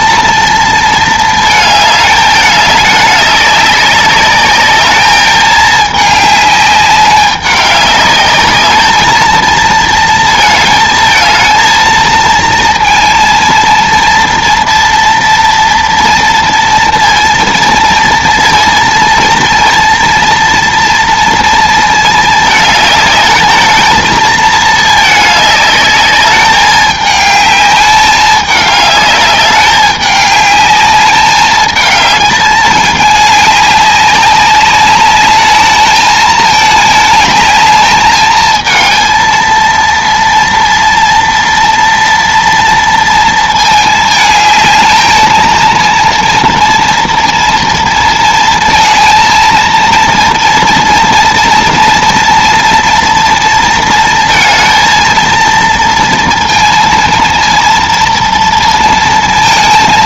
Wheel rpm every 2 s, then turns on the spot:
230, 210, 210, 210, 210, 220, 230, 230, 230, 230, 230, 220, 220, 210, 210, 200, 210, 200, 210, 220, 230, 230, 220, 230, 230, 230, 230, 230, 230, 230.
none